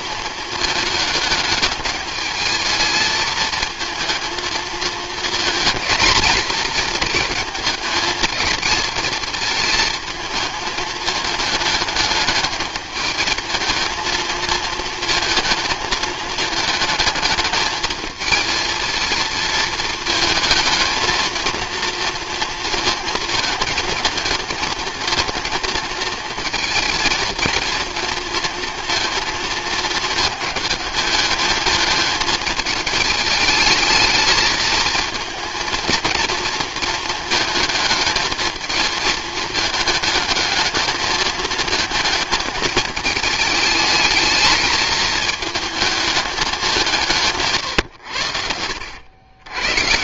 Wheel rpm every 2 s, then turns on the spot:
220, 220, 220, 230, 210, 220, 210, 220, 220, 220, 230, 230, 230, 230, 230, 210, 210, 220, 230, 220, 220, 220, 220, 160, 90.
none